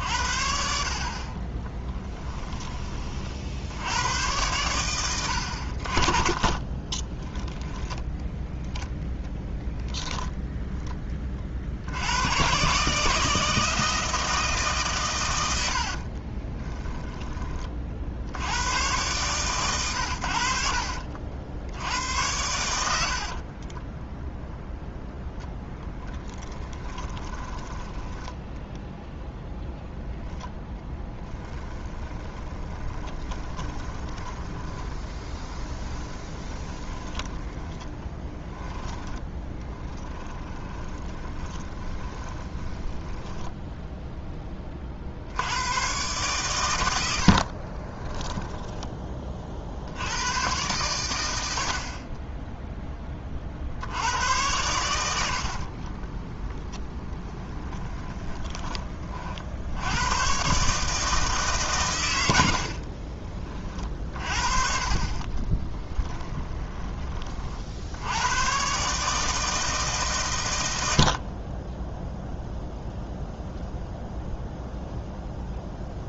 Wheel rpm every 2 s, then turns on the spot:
60, 20, 100, 20, 0, 10, 140, 150, 10, 100, 60, 80, 0, 20, 10, 10, 20, 20, 40, 10, 10, 10, 30, 100, 10, 110, 10, 90, 20, 30, 150, 60, 40, 30, 130, 100, 0, 0.
6-8 16-18 22-24 26-28 30-44 48-50 56-58 62-64 66-68